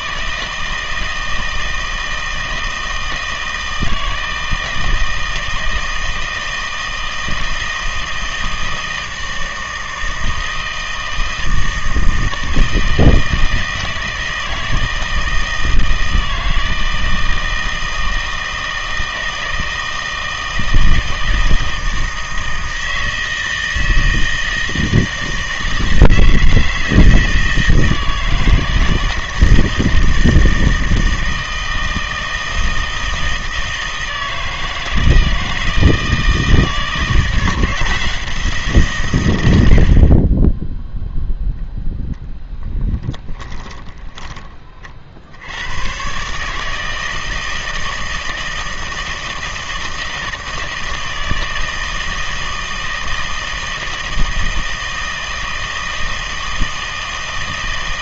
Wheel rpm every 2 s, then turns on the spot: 160, 160, 160, 160, 160, 160, 160, 160, 160, 160, 160, 160, 160, 160, 160, 160, 160, 160, 160, 160, 10, 20, 30, 150, 160, 160, 160, 160, 160.
42-44